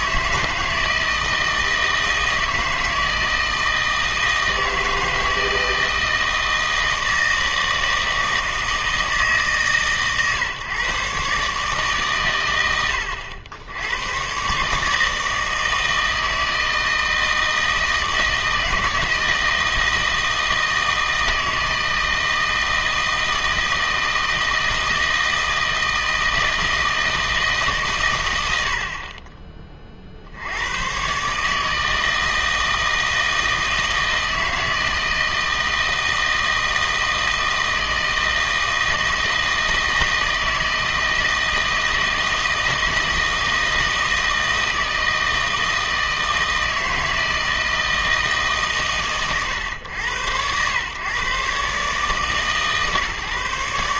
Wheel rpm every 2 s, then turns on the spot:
160, 160, 160, 160, 160, 130, 110, 140, 160, 160, 160, 160, 160, 160, 80, 90, 160, 160, 160, 160, 160, 160, 160, 160, 140, 110, 140.
none